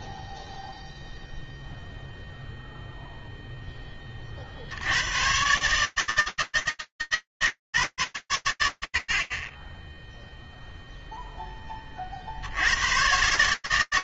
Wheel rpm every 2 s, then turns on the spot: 0, 0, 60, 160, 120, 0, 70.
none